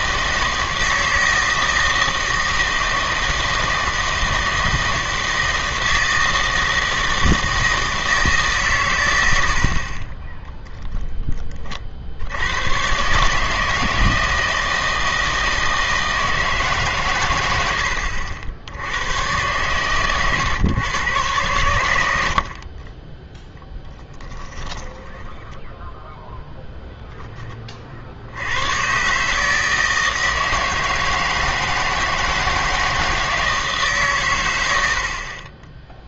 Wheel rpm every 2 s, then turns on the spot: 160, 160, 160, 160, 140, 0, 110, 160, 150, 80, 120, 40, 10, 0, 110, 160, 160, 90.
24-26